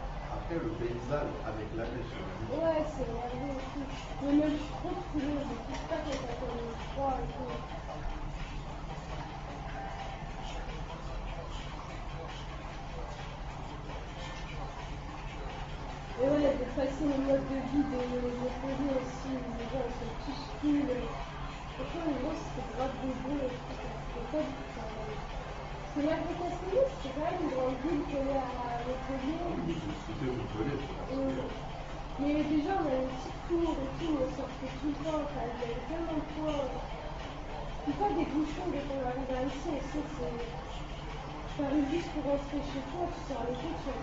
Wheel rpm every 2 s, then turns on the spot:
0, 0, 0, 0, 0, 0, 0, 0, 0, 0, 0, 0, 0, 0, 0, 0, 0, 0, 0, 0, 0, 0.
none